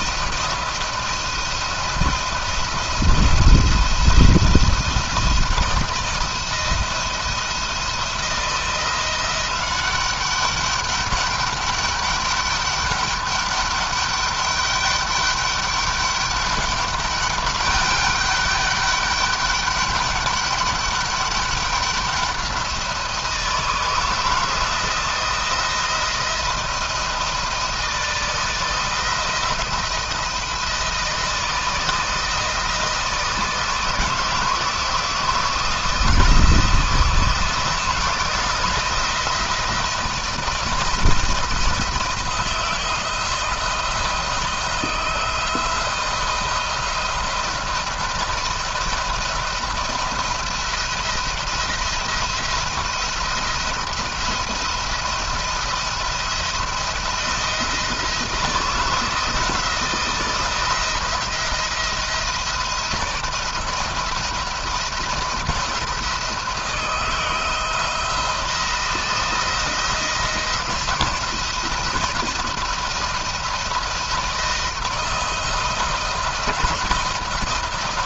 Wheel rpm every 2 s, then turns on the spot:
170, 170, 170, 170, 170, 200, 200, 200, 200, 200, 200, 180, 170, 160, 160, 170, 160, 160, 170, 170, 170, 170, 170, 170, 170, 170, 170, 170, 170, 170, 170, 170, 170, 170, 170, 170, 170, 170, 170.
none